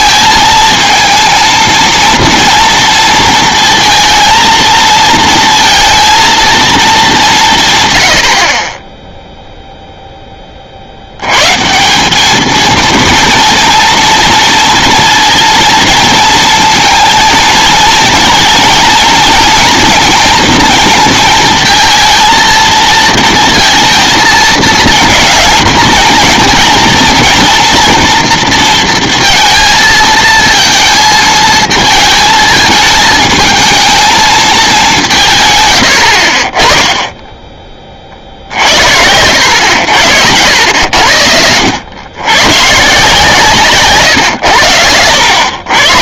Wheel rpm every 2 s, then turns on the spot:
230, 230, 230, 220, 20, 40, 230, 230, 230, 230, 230, 230, 230, 230, 230, 220, 220, 200, 20, 70, 80, 140, 90.
none